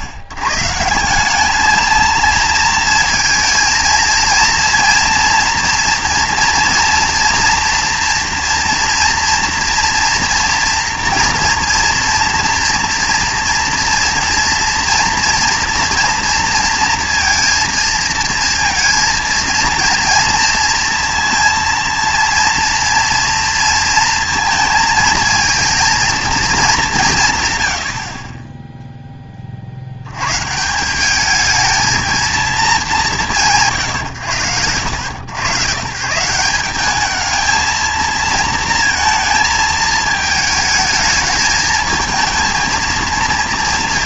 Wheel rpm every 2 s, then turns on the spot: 140, 230, 230, 230, 230, 240, 230, 230, 230, 230, 230, 230, 220, 200, 10, 170, 210, 100, 200, 220, 220, 230.
none